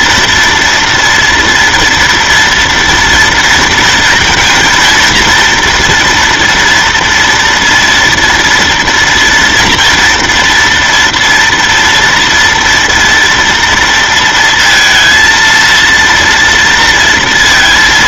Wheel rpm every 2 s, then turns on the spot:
240, 230, 230, 230, 230, 230, 230, 230, 230.
none